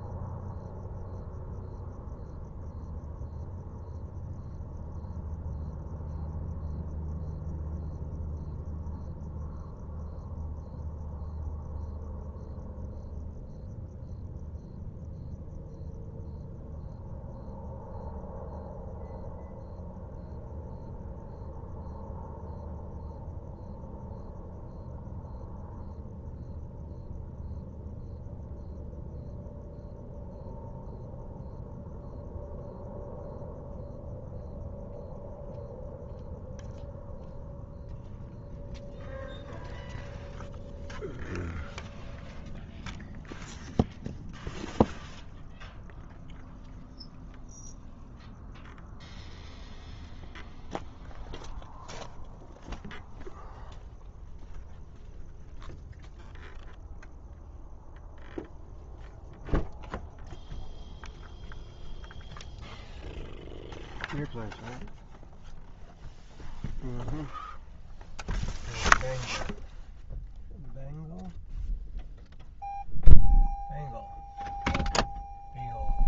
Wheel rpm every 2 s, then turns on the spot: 0, 0, 0, 0, 0, 0, 0, 0, 0, 0, 0, 0, 0, 0, 0, 0, 0, 0, 0, 0, 0, 0, 0, 0, 0, 0, 0, 0, 0, 0, 0, 0, 0, 0, 0, 0, 0, 0.
none